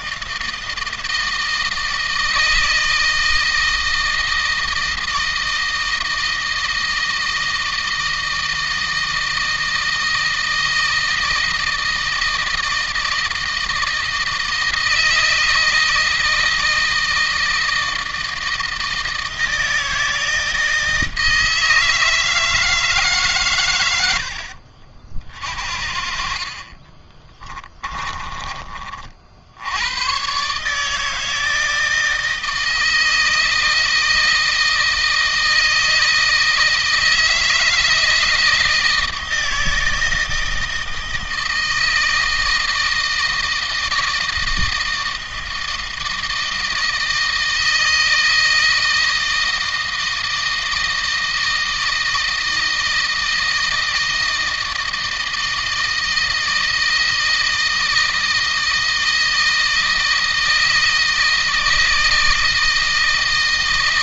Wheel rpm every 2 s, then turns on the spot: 160, 160, 160, 160, 160, 160, 160, 160, 160, 160, 160, 150, 50, 30, 50, 150, 160, 160, 160, 160, 160, 160, 160, 160, 160, 160, 160, 160, 160, 160, 160, 160.
26-28